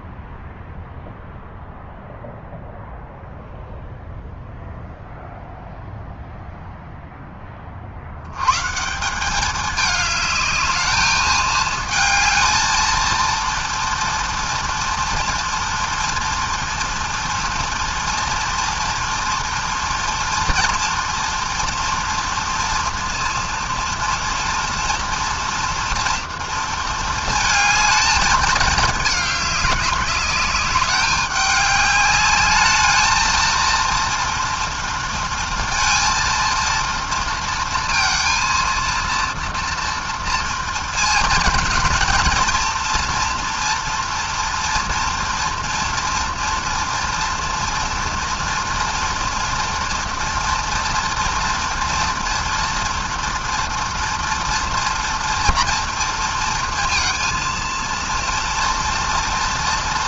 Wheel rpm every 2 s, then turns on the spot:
0, 0, 0, 0, 120, 210, 220, 230, 230, 230, 230, 230, 230, 230, 210, 200, 210, 240, 230, 230, 230, 230, 240, 240, 230, 230, 230, 230, 230, 230.
none